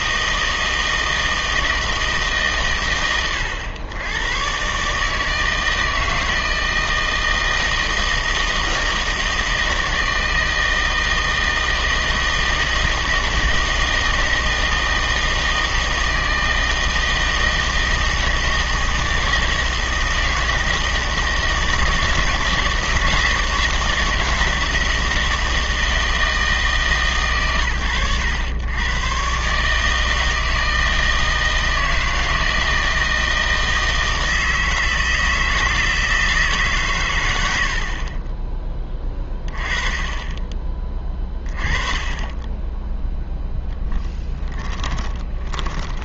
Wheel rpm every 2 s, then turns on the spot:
160, 120, 140, 160, 160, 160, 160, 160, 160, 160, 160, 160, 160, 150, 110, 160, 160, 160, 140, 20, 30, 10, 20.
44-46